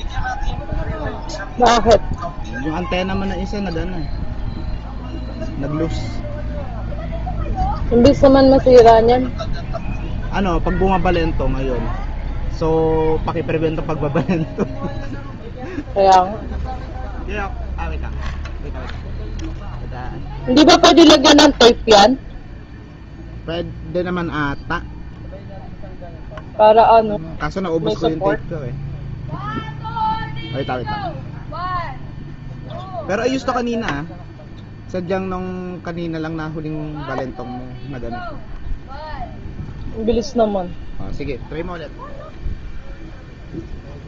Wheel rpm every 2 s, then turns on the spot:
0, 0, 0, 0, 0, 0, 0, 0, 0, 0, 0, 0, 0, 0, 0, 0, 0, 0, 0, 0, 0, 0.
none